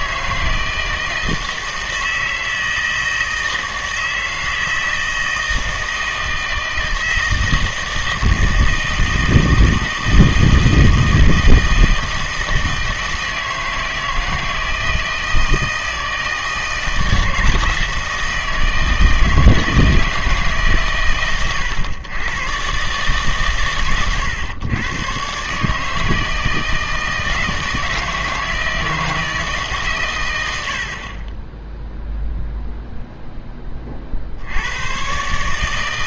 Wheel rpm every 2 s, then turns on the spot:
160, 160, 160, 160, 160, 160, 160, 160, 160, 160, 130, 130, 110, 160, 160, 80, 0, 90.
none